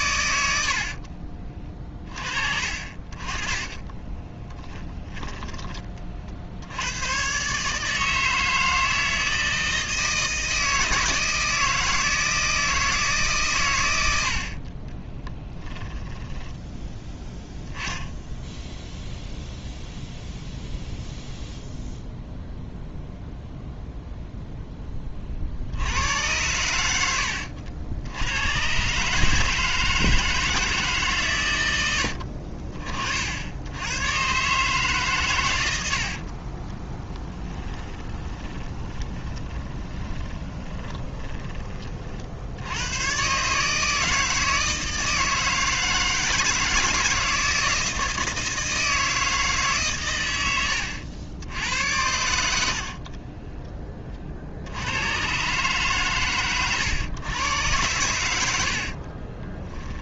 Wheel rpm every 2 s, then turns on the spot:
60, 40, 10, 90, 160, 160, 160, 30, 10, 0, 0, 0, 10, 90, 130, 150, 40, 140, 10, 20, 20, 100, 160, 160, 160, 90, 60, 90, 120, 60.
0-2 4-6 14-16 36-42 50-54 58-60